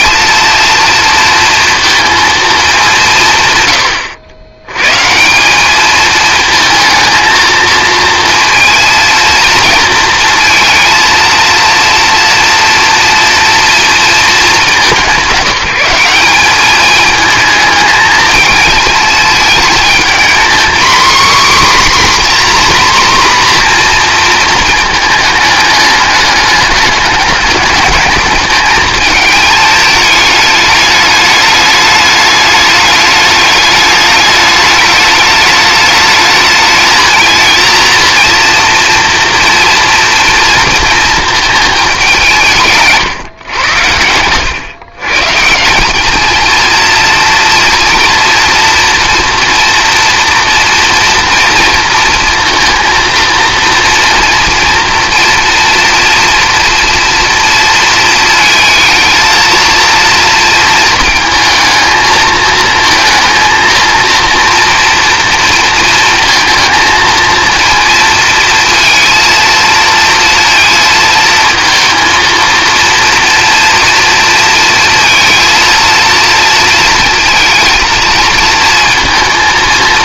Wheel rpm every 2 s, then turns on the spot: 230, 190, 110, 220, 230, 230, 230, 200, 210, 220, 250, 260, 220, 210, 220, 210, 210, 210, 220, 230, 230, 160, 120, 230, 230, 230, 230, 230, 230, 220, 230, 230, 240, 230, 230, 230, 230, 230, 230, 230.
none